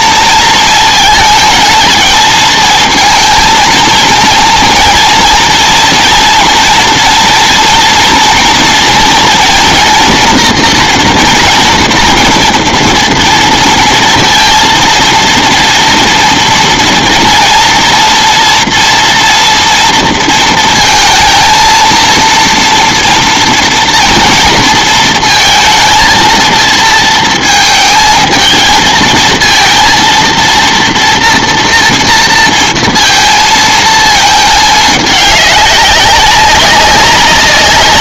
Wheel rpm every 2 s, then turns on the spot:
220, 230, 230, 230, 230, 240, 240, 230, 230, 230, 230, 230, 230, 230, 220, 230, 230, 210, 190.
none